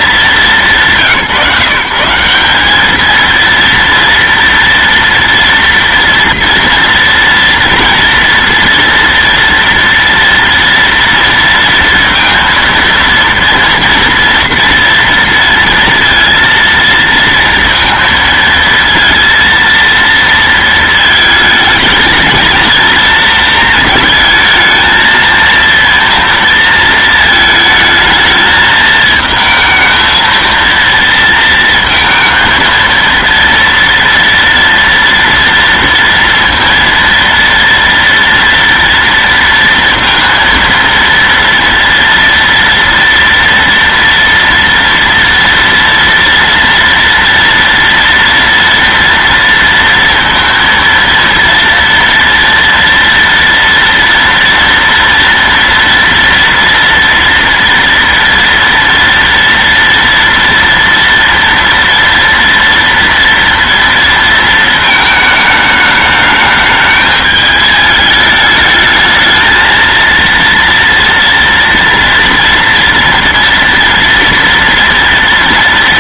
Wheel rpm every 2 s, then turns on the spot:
210, 170, 230, 230, 230, 230, 230, 230, 230, 230, 230, 220, 220, 230, 220, 230, 230, 230, 230, 230, 230, 230, 230, 230, 230, 230, 240, 230, 230, 230, 240, 230, 230, 210, 210, 230, 230, 230.
none